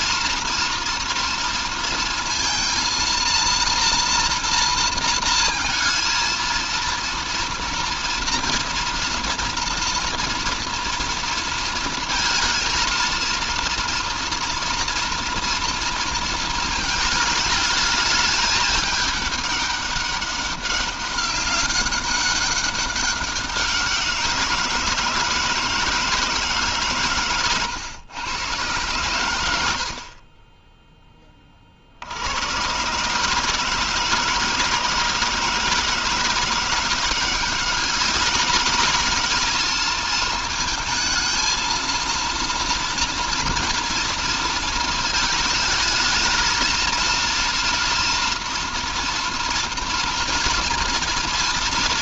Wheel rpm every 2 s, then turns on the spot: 230, 230, 230, 230, 230, 230, 230, 240, 220, 210, 200, 200, 160, 140, 110, 10, 130, 160, 180, 210, 220, 230, 220, 230, 230, 230.
none